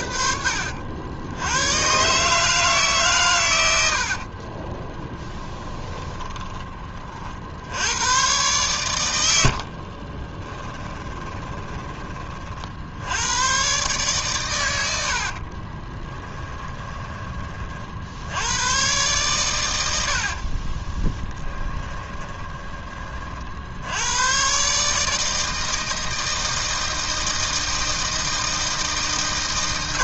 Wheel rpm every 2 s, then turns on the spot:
70, 150, 20, 30, 110, 20, 60, 100, 20, 110, 30, 20, 140, 160, 160.
4-8 10-12 16-18 20-22